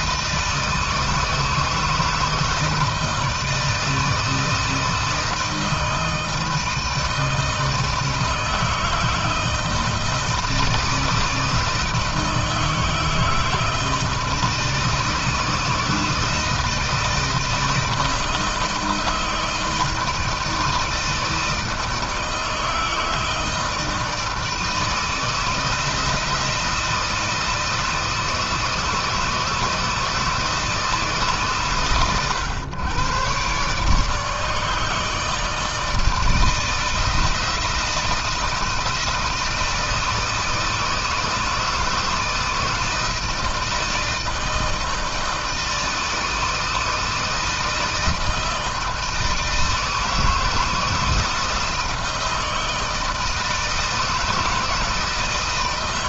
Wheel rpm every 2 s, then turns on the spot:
160, 160, 160, 160, 160, 160, 160, 160, 160, 160, 160, 160, 160, 170, 160, 160, 100, 150, 160, 160, 160, 160, 160, 160, 160, 160, 160, 160.
none